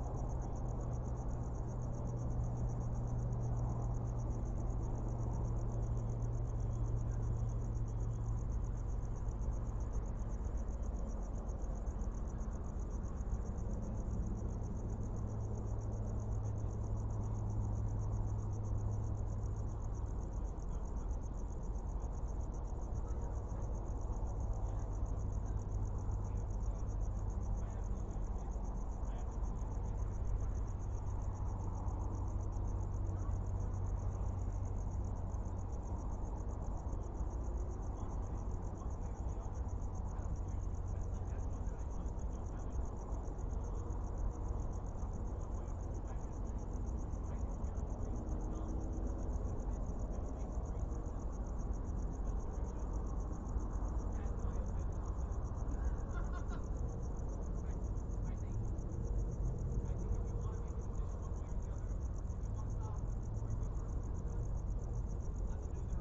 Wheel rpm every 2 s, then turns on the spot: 0, 0, 0, 0, 0, 0, 0, 0, 0, 0, 0, 0, 0, 0, 0, 0, 0, 0, 0, 0, 0, 0, 0, 0, 0, 0, 0, 0, 0, 0, 0, 0, 0.
none